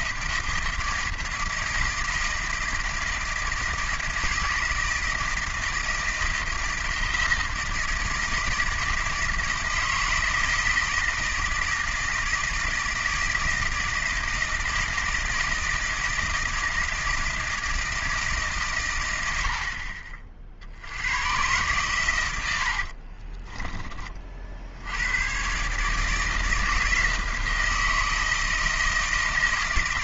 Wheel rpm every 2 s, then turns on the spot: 160, 160, 160, 160, 160, 160, 160, 160, 160, 140, 60, 70, 60, 160, 160.
22-24